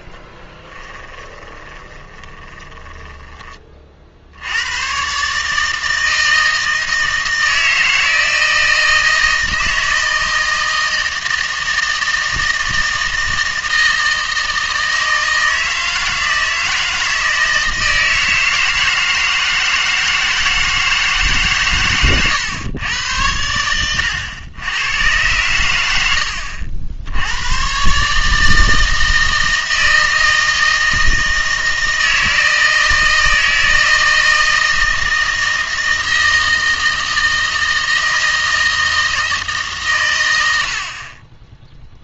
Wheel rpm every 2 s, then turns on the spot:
10, 10, 100, 160, 160, 160, 160, 160, 160, 160, 160, 100, 100, 70, 160, 160, 160, 160, 160, 160, 70.
0-4